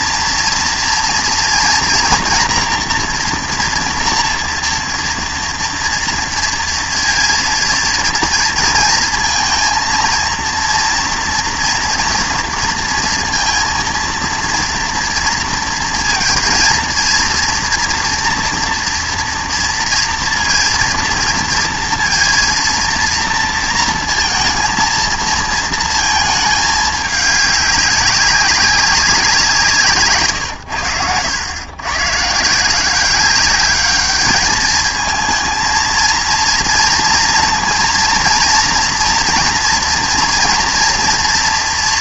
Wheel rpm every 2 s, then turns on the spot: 230, 240, 240, 230, 230, 230, 230, 230, 230, 230, 230, 230, 230, 220, 190, 120, 150, 210, 230, 230, 230.
none